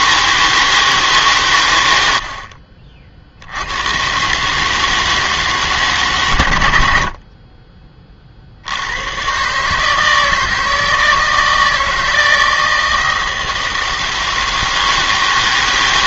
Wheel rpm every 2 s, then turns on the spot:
160, 60, 150, 90, 70, 160, 160, 160.
2-4